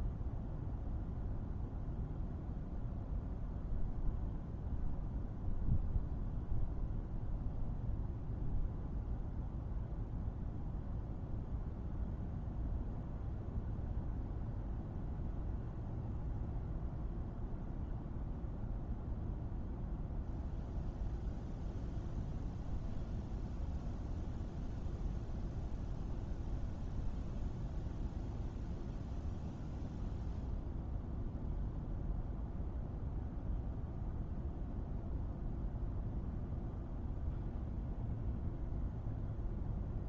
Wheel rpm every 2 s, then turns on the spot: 0, 0, 0, 0, 0, 0, 0, 0, 0, 0, 0, 0, 0, 0, 0, 0, 0, 0, 0, 0.
none